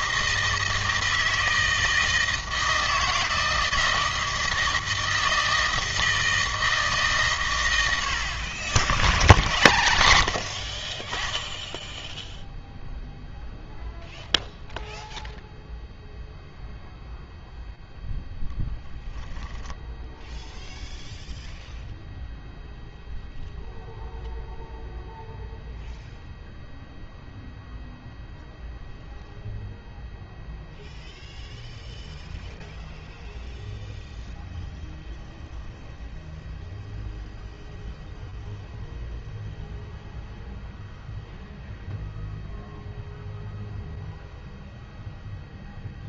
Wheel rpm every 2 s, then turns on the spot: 160, 160, 160, 150, 50, 30, 0, 0, 0, 0, 0, 0, 0, 0, 0, 0, 0, 0, 0, 0, 0, 0, 0.
10-12